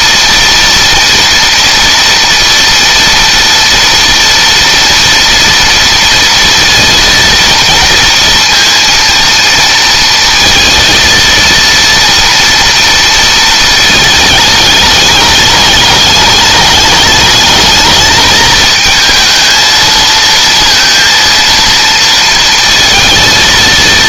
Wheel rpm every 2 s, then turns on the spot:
230, 230, 230, 230, 230, 230, 230, 210, 210, 220, 230, 230.
none